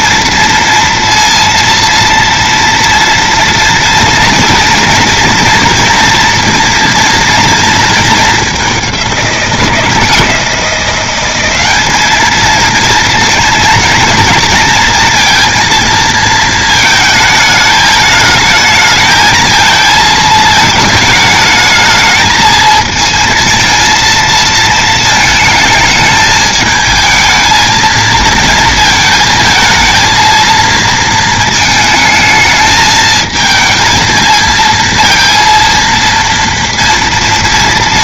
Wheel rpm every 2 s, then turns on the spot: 230, 240, 230, 230, 200, 180, 230, 230, 220, 220, 220, 220, 220, 220, 220, 230, 220, 230, 230.
none